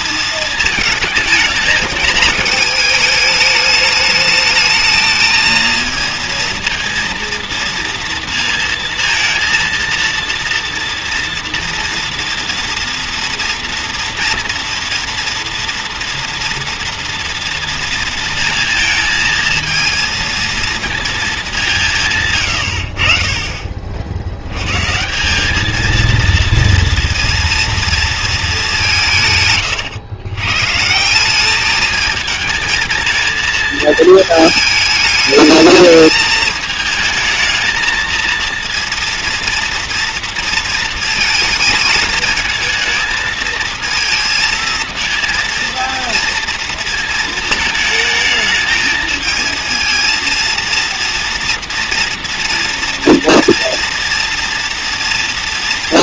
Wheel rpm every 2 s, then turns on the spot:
220, 220, 220, 230, 230, 230, 230, 230, 230, 230, 230, 100, 110, 230, 210, 130, 220, 220, 220, 230, 230, 220, 220, 230, 220, 230, 230, 230.
none